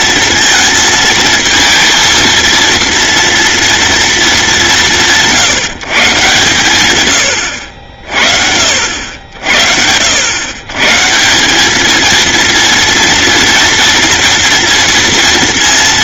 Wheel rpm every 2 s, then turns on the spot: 230, 230, 190, 110, 70, 140, 230, 230.
none